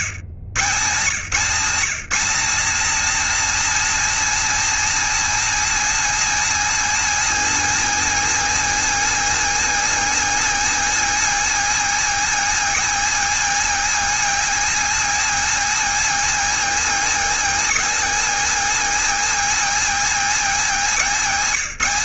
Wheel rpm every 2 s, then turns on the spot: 150, 260, 280, 280, 280, 280, 280, 280, 260, 270, 240.
none